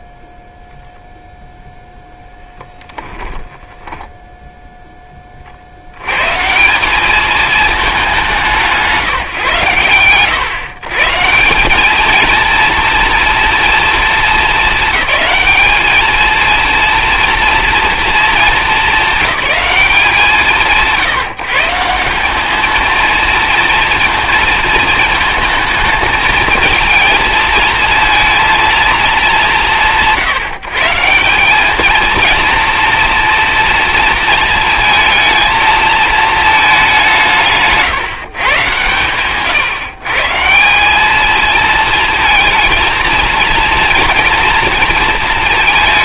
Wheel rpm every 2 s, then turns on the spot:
0, 10, 10, 180, 180, 120, 230, 220, 230, 200, 180, 220, 220, 220, 230, 150, 230, 230, 210, 130, 180, 230, 230.
2-4